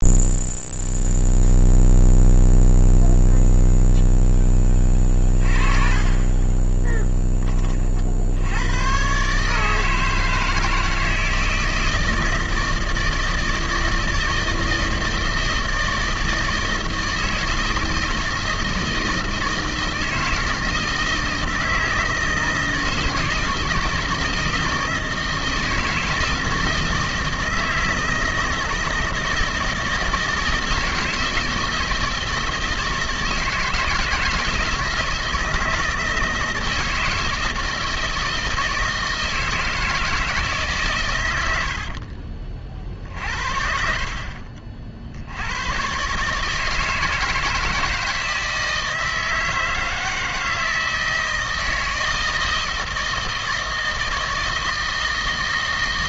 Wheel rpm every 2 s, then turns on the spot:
0, 0, 20, 30, 90, 160, 160, 160, 160, 160, 160, 160, 160, 160, 160, 160, 160, 160, 160, 160, 140, 50, 40, 150, 160, 160, 160, 160.
6-8